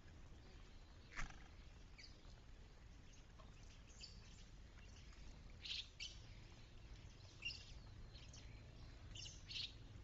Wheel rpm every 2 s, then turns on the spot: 0, 0, 0, 0, 0.
none